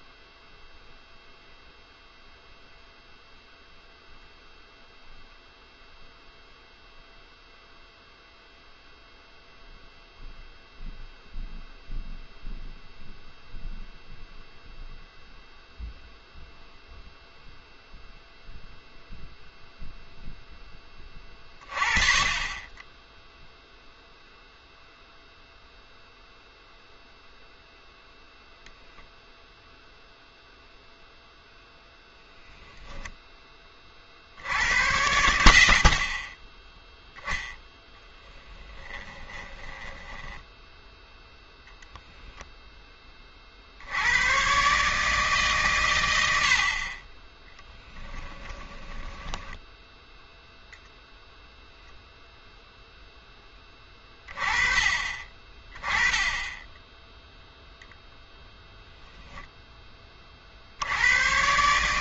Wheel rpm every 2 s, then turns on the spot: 0, 0, 0, 0, 0, 0, 0, 0, 0, 0, 10, 20, 0, 0, 0, 0, 0, 80, 20, 10, 10, 10, 140, 50, 20, 0, 0, 30, 10, 0, 60.
38-42 48-50